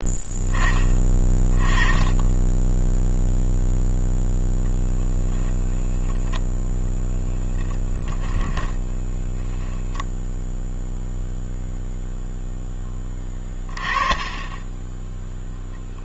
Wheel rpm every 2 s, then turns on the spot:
20, 0, 10, 10, 40, 0, 10, 10.
8-10